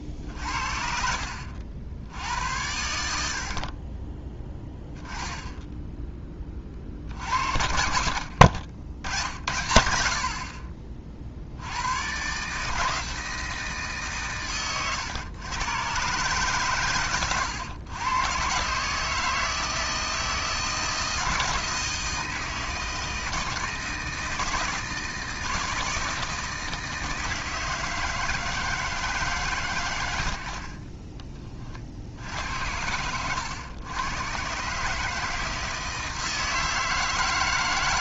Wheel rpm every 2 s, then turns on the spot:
60, 90, 10, 30, 60, 30, 150, 120, 130, 130, 160, 160, 160, 160, 160, 40, 90, 150, 160.
14-16 30-32